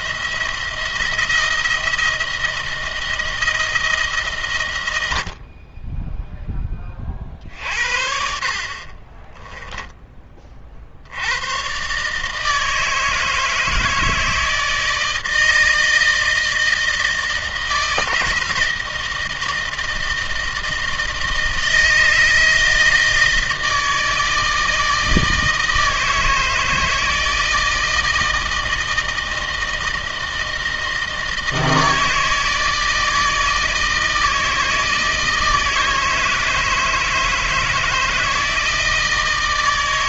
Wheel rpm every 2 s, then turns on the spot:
170, 170, 110, 10, 50, 50, 160, 160, 160, 160, 160, 160, 160, 160, 160, 160, 160, 160, 160, 160.
8-10